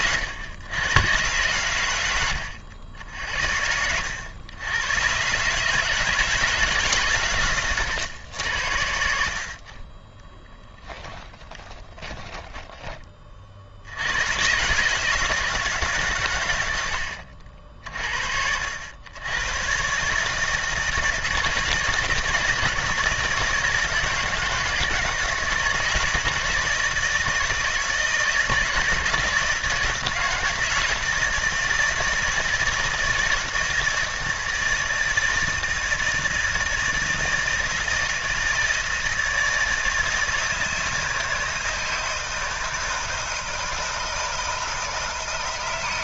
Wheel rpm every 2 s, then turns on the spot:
80, 100, 90, 160, 110, 20, 20, 120, 110, 70, 160, 160, 160, 160, 160, 160, 160, 160, 160, 160, 160, 160, 160.
12-14